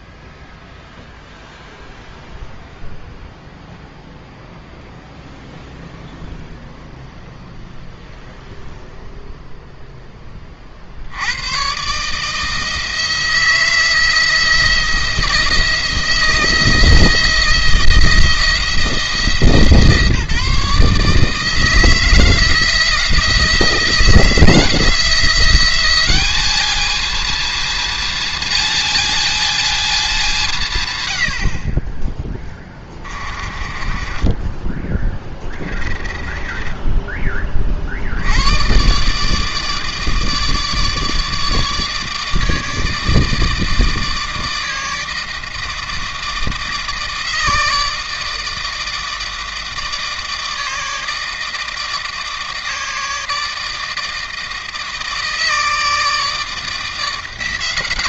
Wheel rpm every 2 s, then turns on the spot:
0, 0, 0, 0, 0, 50, 160, 170, 160, 170, 160, 170, 170, 210, 220, 160, 20, 20, 20, 120, 160, 160, 160, 160, 160, 160, 160, 160, 160.
32-34 36-38